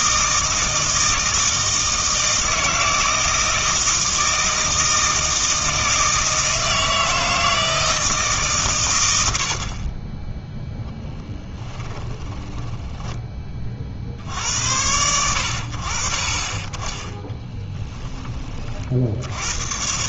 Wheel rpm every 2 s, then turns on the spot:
160, 160, 160, 160, 130, 0, 10, 90, 20, 40.
12-14